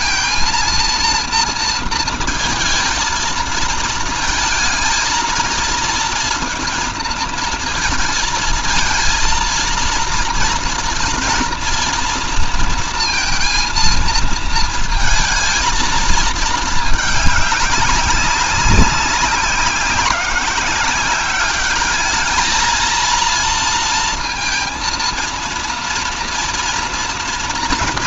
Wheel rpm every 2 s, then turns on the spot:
230, 230, 220, 230, 230, 230, 230, 220, 220, 190, 190, 220, 230, 240.
none